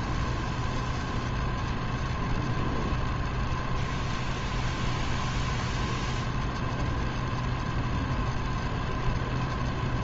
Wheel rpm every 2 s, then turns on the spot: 0, 0, 0, 0, 0.
none